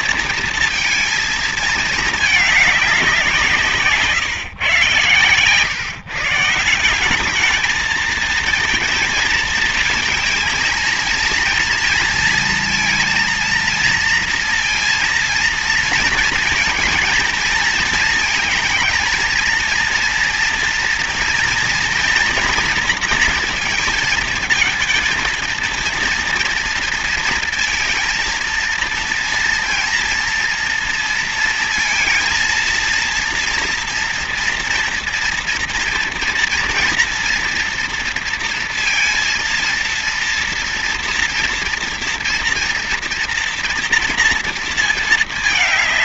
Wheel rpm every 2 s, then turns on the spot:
230, 210, 140, 150, 220, 220, 230, 230, 230, 220, 240, 230, 220, 230, 230, 230, 230, 230, 230, 230, 230, 230, 230.
none